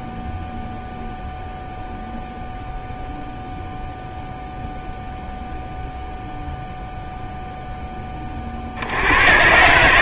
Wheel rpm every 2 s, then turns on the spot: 0, 0, 0, 0, 50.
none